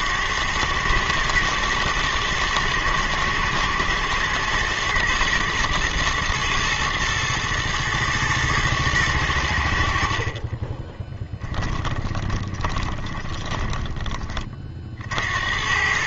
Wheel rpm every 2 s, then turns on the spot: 90, 110, 120, 120, 110, 50, 20, 20.
12-14